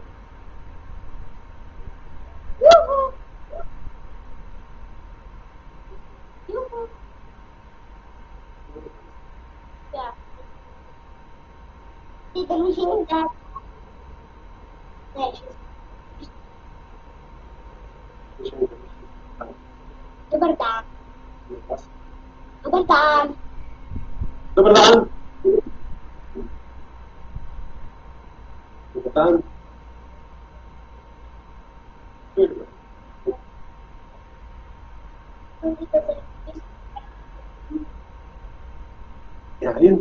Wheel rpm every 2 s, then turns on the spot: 0, 0, 0, 0, 0, 0, 0, 0, 0, 0, 0, 0, 0, 0, 0, 0, 0, 0, 0, 0.
none